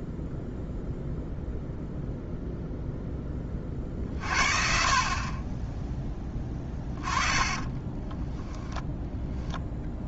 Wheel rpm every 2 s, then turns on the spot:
0, 0, 40, 20, 10.
6-8